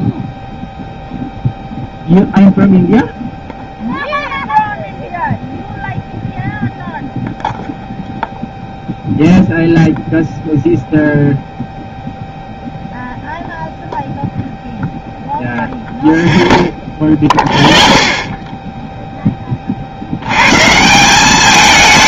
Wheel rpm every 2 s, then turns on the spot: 0, 0, 0, 0, 0, 0, 0, 0, 0, 0, 140.
none